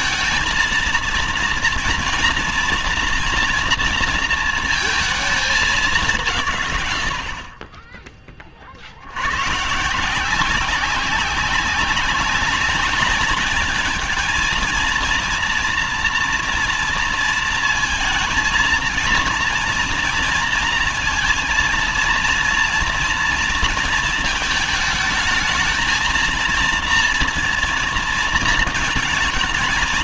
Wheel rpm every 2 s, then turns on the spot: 230, 230, 230, 130, 50, 180, 200, 230, 230, 230, 230, 230, 220, 230, 230.
none